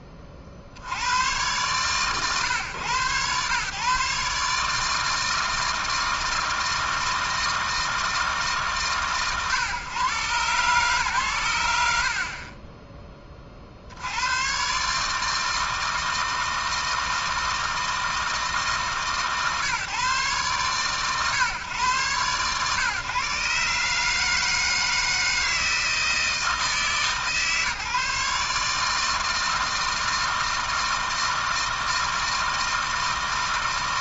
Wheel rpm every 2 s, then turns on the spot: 70, 130, 160, 160, 130, 140, 30, 140, 160, 150, 120, 130, 160, 150, 160, 160, 160.
none